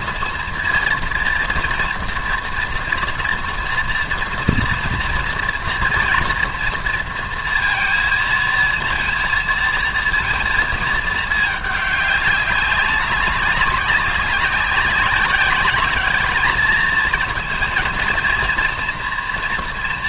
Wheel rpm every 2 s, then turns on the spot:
230, 230, 230, 230, 230, 220, 200, 190, 210, 230.
none